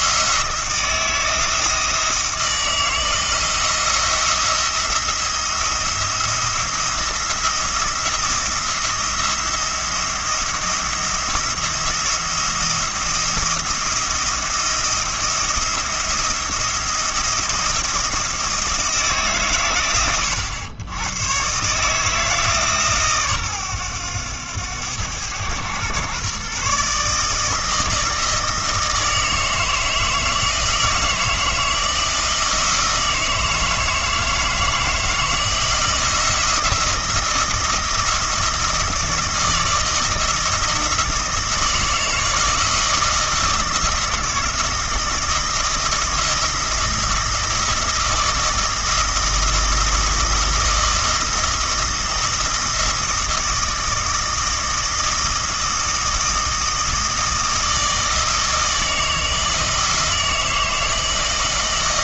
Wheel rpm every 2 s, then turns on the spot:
170, 160, 170, 170, 170, 170, 170, 170, 170, 160, 100, 150, 100, 140, 160, 160, 160, 160, 170, 160, 160, 160, 170, 170, 160, 170, 160, 160, 160, 160, 160.
none